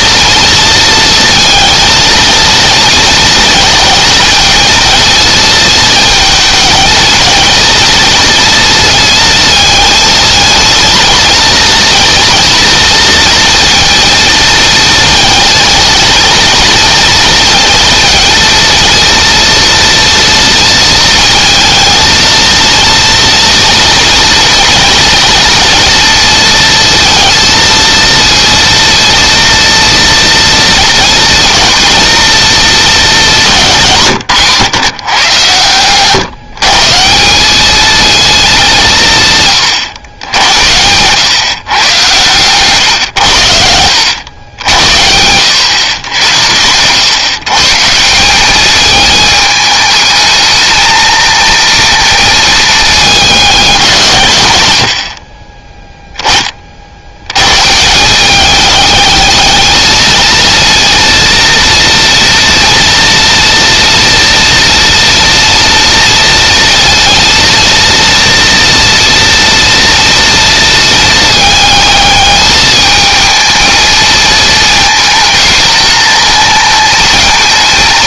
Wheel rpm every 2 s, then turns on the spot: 230, 230, 230, 220, 230, 230, 230, 230, 230, 240, 220, 230, 230, 230, 230, 240, 230, 140, 160, 180, 100, 120, 90, 120, 210, 220, 210, 70, 50, 210, 230, 240, 240, 230, 230, 220, 220, 220, 220.
none